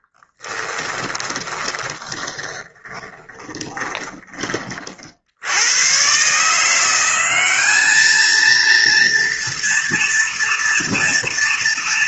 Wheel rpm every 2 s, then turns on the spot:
10, 20, 30, 170, 230, 230.
0-4